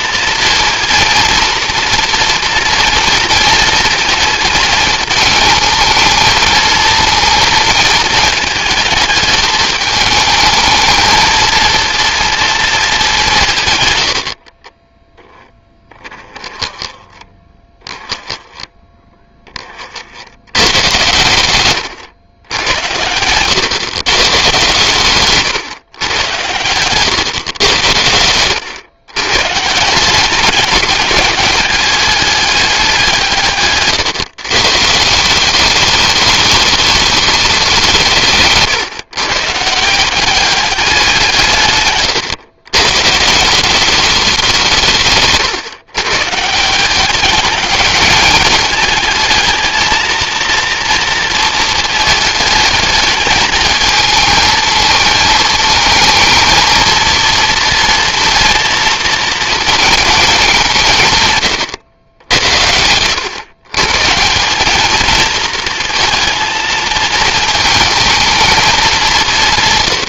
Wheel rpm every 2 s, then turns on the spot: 230, 230, 220, 220, 220, 220, 200, 10, 10, 10, 100, 100, 130, 110, 110, 200, 190, 160, 210, 140, 190, 120, 170, 160, 220, 240, 220, 220, 230, 230, 170, 70, 210, 230, 210.
14-16 22-24